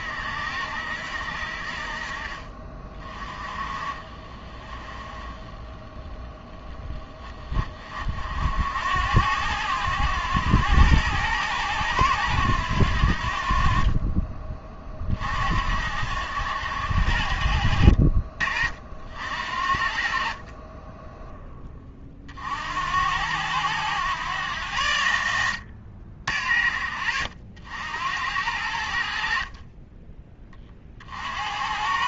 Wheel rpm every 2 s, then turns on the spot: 70, 30, 20, 10, 80, 100, 80, 30, 80, 60, 20, 80, 90, 60, 80, 40.
none